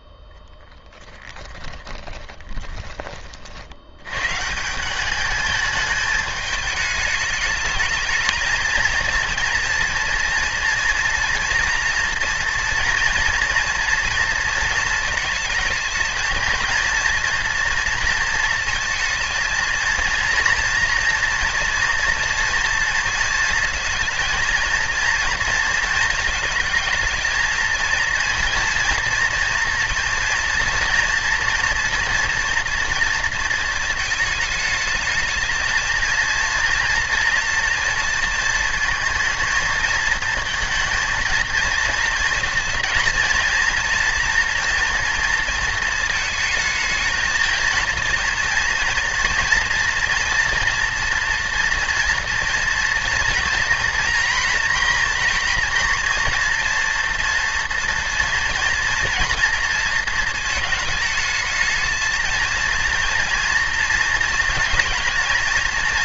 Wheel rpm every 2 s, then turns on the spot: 10, 20, 190, 210, 220, 230, 230, 220, 230, 220, 230, 230, 230, 220, 230, 230, 230, 210, 230, 220, 230, 230, 230, 220, 230, 230, 230, 230, 230, 240, 220, 230, 220.
none